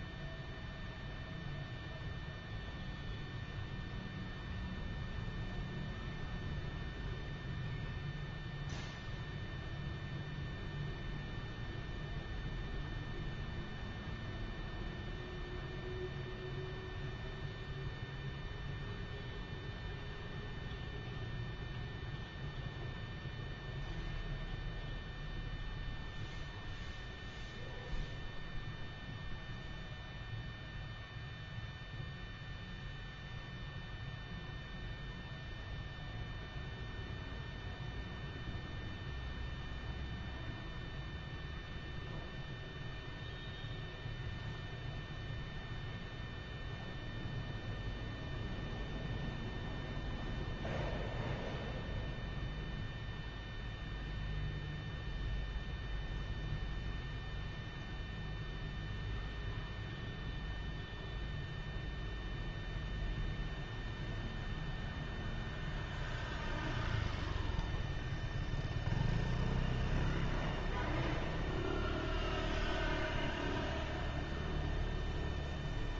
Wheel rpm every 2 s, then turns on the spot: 0, 0, 0, 0, 0, 0, 0, 0, 0, 0, 0, 0, 0, 0, 0, 0, 0, 0, 0, 0, 0, 0, 0, 0, 0, 0, 0, 0, 0, 0, 0, 0, 0, 0, 0, 0, 0, 0.
none